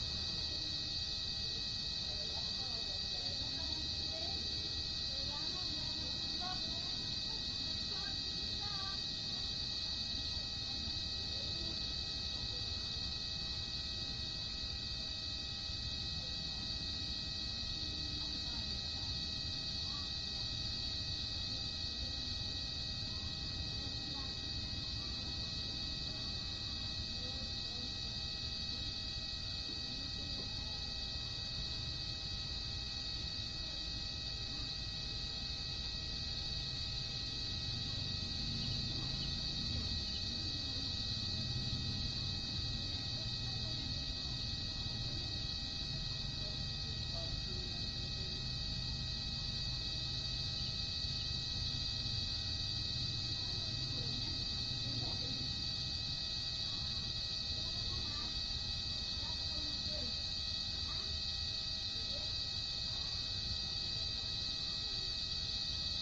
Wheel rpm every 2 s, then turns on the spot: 0, 0, 0, 0, 0, 0, 0, 0, 0, 0, 0, 0, 0, 0, 0, 0, 0, 0, 0, 0, 0, 0, 0, 0, 0, 0, 0, 0, 0, 0, 0, 0, 0.
none